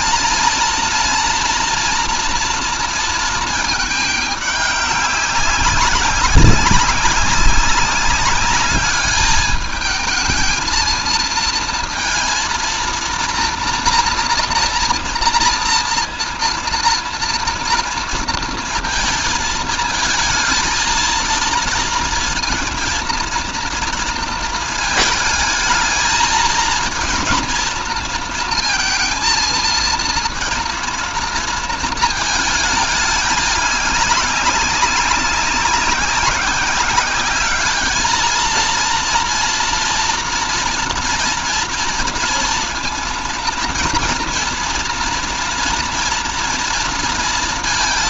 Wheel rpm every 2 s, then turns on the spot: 230, 230, 200, 200, 200, 220, 230, 230, 230, 230, 220, 230, 220, 230, 230, 230, 220, 190, 190, 230, 230, 230, 230, 230.
none